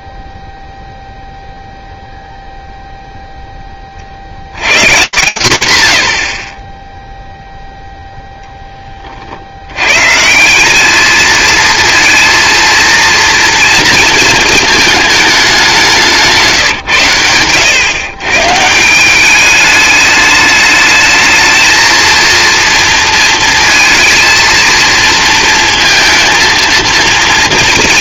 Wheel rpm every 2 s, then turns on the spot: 0, 0, 150, 60, 20, 200, 230, 220, 150, 160, 210, 230, 220, 230.
none